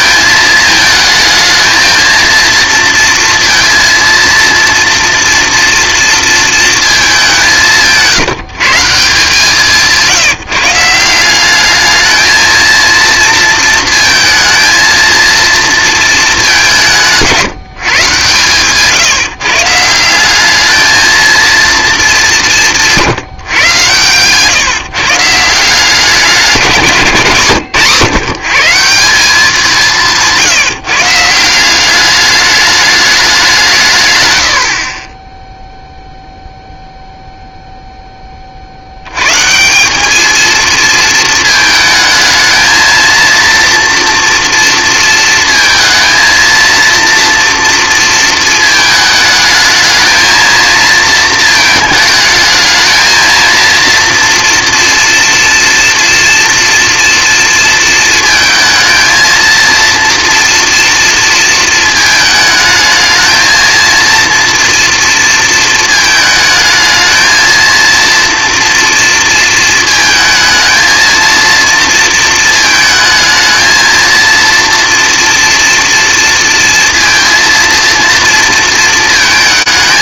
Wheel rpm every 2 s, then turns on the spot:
220, 230, 230, 230, 170, 160, 220, 230, 190, 130, 210, 170, 130, 180, 150, 160, 210, 90, 0, 50, 220, 220, 230, 230, 220, 230, 220, 230, 240, 220, 230, 220, 230, 220, 230, 220, 220, 230, 230, 230.
none